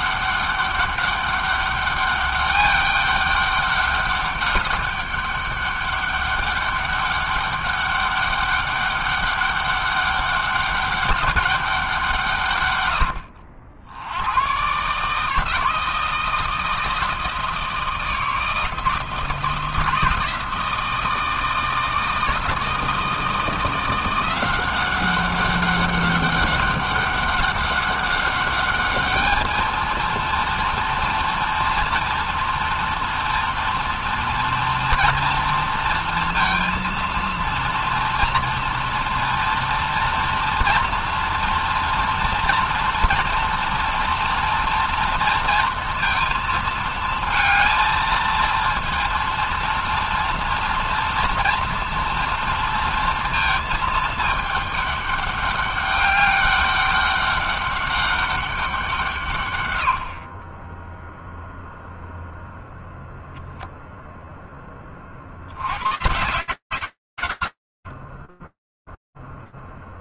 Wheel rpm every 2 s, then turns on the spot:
200, 200, 200, 200, 200, 200, 70, 160, 160, 160, 160, 160, 190, 200, 220, 230, 230, 230, 230, 230, 230, 230, 230, 220, 230, 230, 220, 200, 200, 90, 0, 0, 90, 70, 0.
none